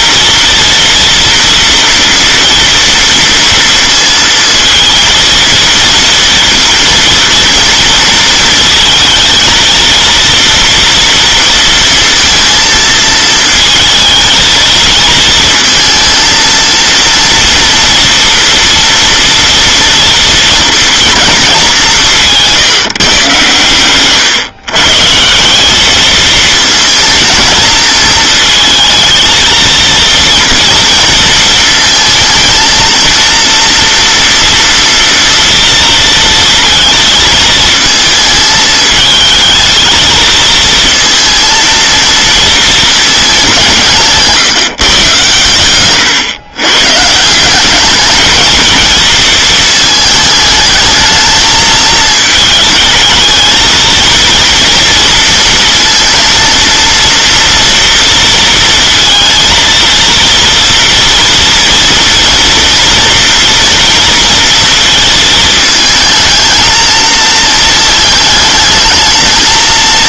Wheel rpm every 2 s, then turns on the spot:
230, 230, 230, 230, 230, 230, 230, 220, 220, 230, 230, 160, 120, 220, 220, 230, 230, 230, 220, 220, 230, 230, 160, 130, 220, 220, 220, 230, 230, 230, 230, 230, 230, 220, 220.
none